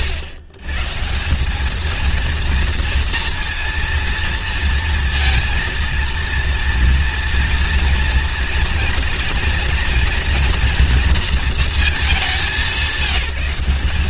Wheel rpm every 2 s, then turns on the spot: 130, 230, 230, 230, 230, 240, 180.
none